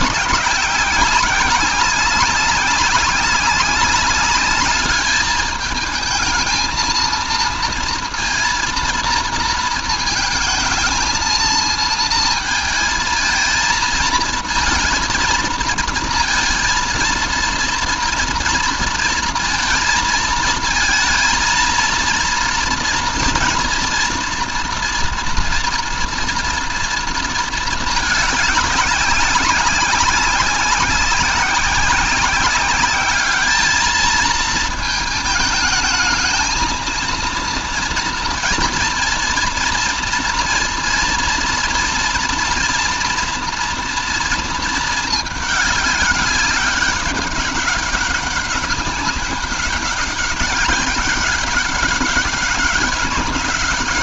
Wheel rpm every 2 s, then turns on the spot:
190, 190, 210, 220, 230, 230, 230, 230, 230, 230, 220, 230, 230, 230, 200, 190, 190, 220, 220, 230, 230, 230, 220, 200, 200, 200, 200.
none